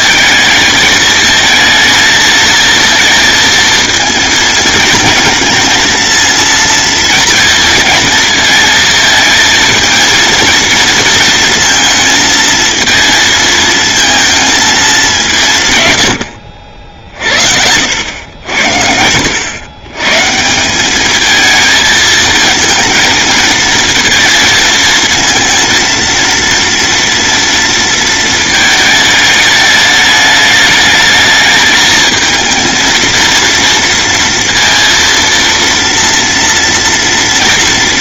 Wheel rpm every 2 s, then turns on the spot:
220, 230, 220, 230, 230, 220, 230, 220, 60, 70, 190, 220, 230, 230, 220, 210, 220, 230, 230.
none